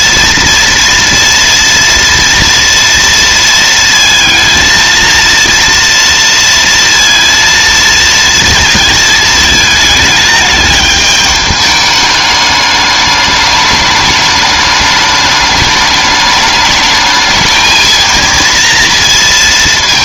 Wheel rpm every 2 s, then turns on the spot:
230, 230, 230, 230, 220, 210, 210, 210, 220, 230.
none